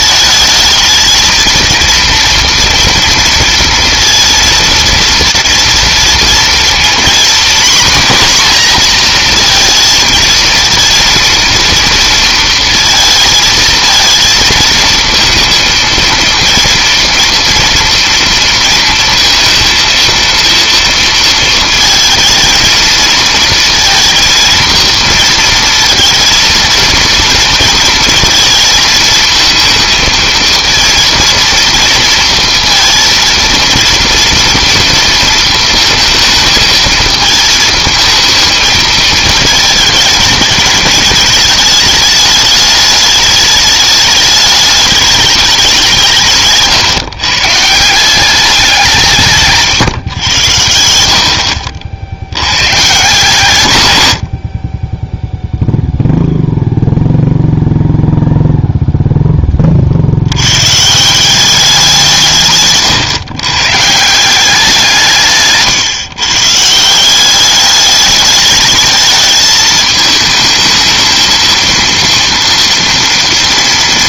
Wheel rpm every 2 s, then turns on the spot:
220, 230, 230, 230, 240, 230, 230, 220, 230, 230, 230, 220, 230, 230, 220, 230, 230, 230, 220, 220, 220, 210, 210, 150, 180, 90, 120, 40, 0, 0, 130, 130, 180, 160, 220, 220, 230.
50-52 62-64